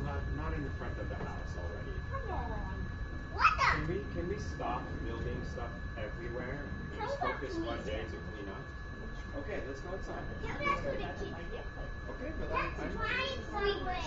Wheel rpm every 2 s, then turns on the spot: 0, 0, 0, 0, 0, 0, 0.
none